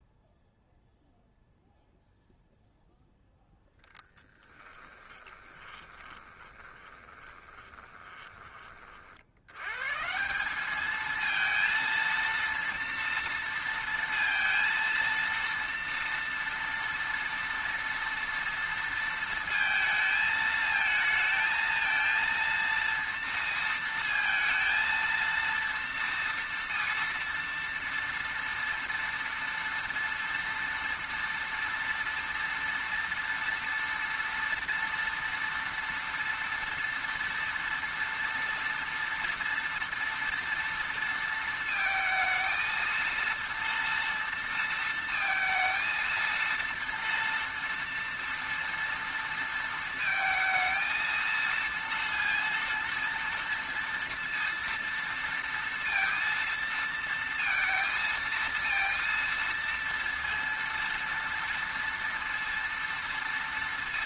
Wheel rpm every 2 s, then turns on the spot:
0, 0, 20, 20, 30, 200, 230, 230, 230, 230, 220, 230, 220, 230, 230, 230, 230, 230, 230, 230, 230, 220, 230, 230, 230, 230, 230, 230, 230, 230, 230, 230.
4-8